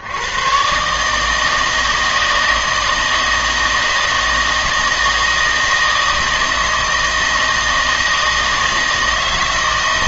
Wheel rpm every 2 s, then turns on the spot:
120, 160, 160, 160, 160.
none